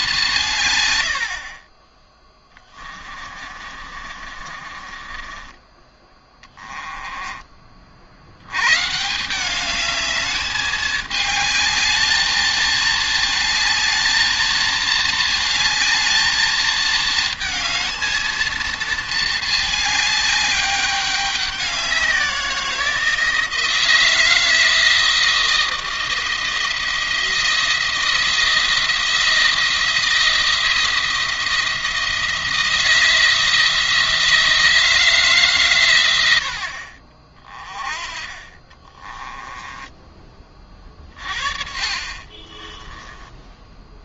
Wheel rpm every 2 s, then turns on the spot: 120, 30, 30, 20, 140, 210, 220, 220, 220, 220, 200, 170, 160, 170, 170, 170, 170, 160, 50, 30, 30, 20.
2-8 38-40 42-44